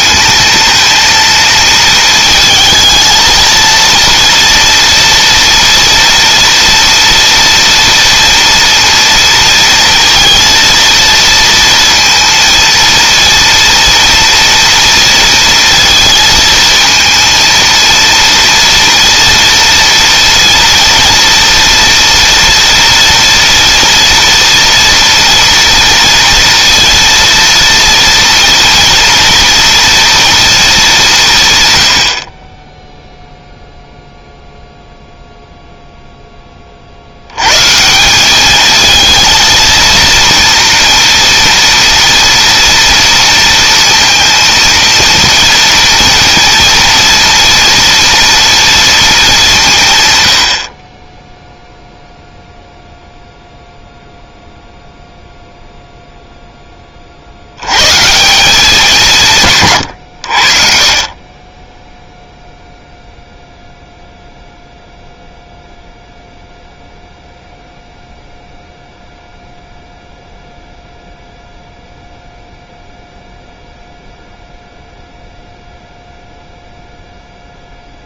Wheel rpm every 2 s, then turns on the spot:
230, 230, 240, 230, 230, 230, 230, 230, 230, 230, 230, 230, 230, 230, 230, 200, 0, 0, 70, 220, 230, 230, 230, 230, 220, 20, 0, 0, 40, 190, 40, 0, 0, 0, 0, 0, 0, 0, 0.
none